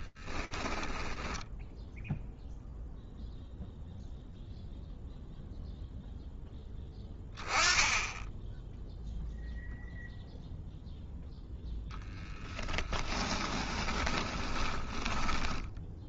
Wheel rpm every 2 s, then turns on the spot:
10, 0, 0, 10, 0, 10, 20, 10.
0-2 10-16